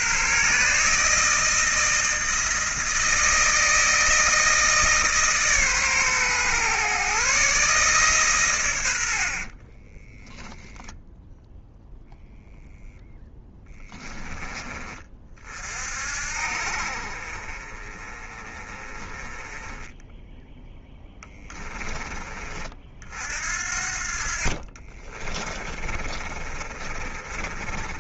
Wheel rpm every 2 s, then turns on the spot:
150, 160, 150, 130, 80, 0, 0, 30, 40, 20, 10, 50, 30, 30.
20-22 24-28